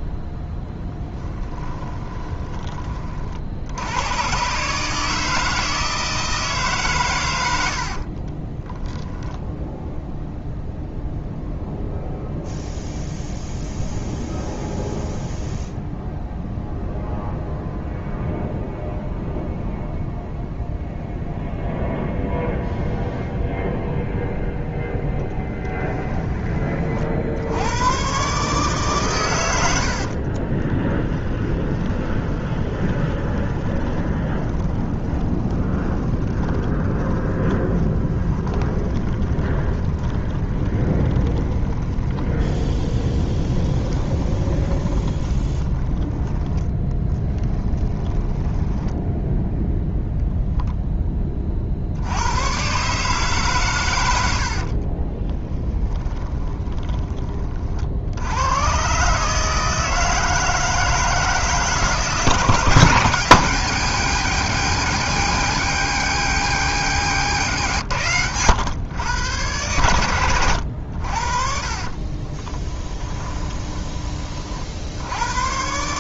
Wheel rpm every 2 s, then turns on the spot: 10, 30, 150, 140, 10, 0, 0, 0, 0, 0, 0, 0, 0, 40, 130, 20, 20, 20, 10, 20, 20, 20, 20, 10, 10, 10, 140, 40, 20, 130, 160, 160, 140, 100, 110, 80, 10, 90.
0-2 8-10 30-50 54-58 66-68 72-74